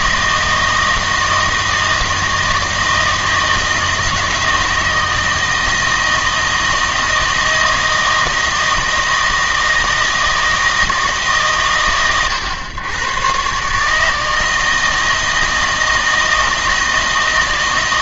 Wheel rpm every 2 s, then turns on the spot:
160, 160, 160, 160, 160, 160, 110, 160, 160.
none